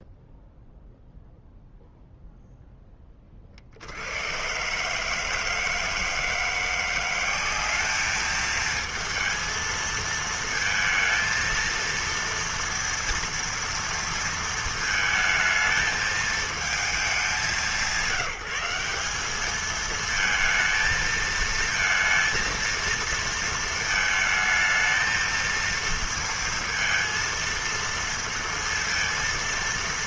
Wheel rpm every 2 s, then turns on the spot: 0, 0, 120, 170, 220, 220, 230, 220, 220, 170, 220, 230, 220, 230, 230.
none